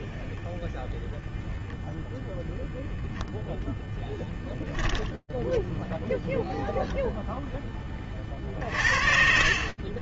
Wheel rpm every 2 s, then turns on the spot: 0, 0, 50, 60, 0.
none